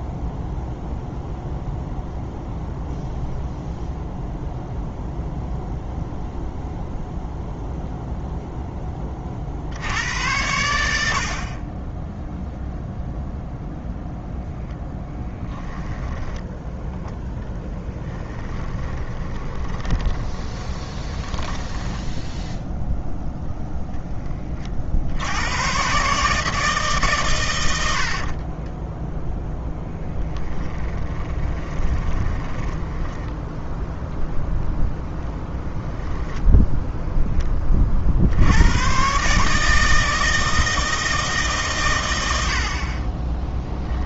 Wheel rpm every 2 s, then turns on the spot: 0, 0, 0, 0, 0, 100, 0, 0, 10, 10, 20, 0, 30, 150, 20, 10, 10, 0, 0, 80, 160, 90.
16-22 28-34